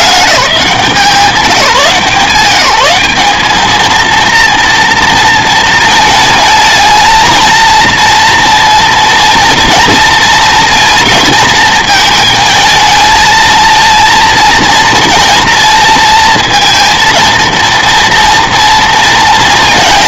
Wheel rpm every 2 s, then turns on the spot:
180, 160, 230, 220, 230, 230, 220, 230, 230, 230.
none